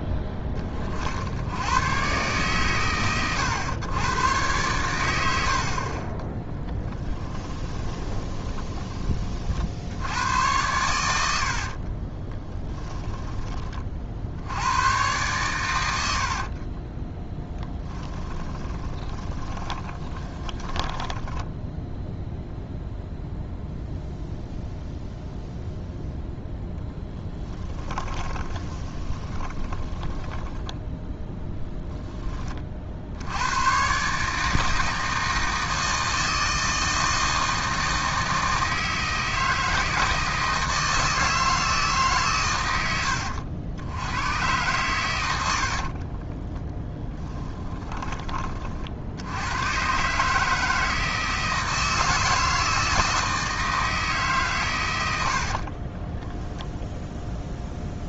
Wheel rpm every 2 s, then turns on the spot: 20, 120, 110, 10, 20, 100, 10, 110, 30, 20, 30, 0, 0, 0, 20, 10, 40, 160, 160, 160, 160, 100, 110, 10, 50, 160, 160, 130, 0.
6-8 12-14 16-22 28-32 46-48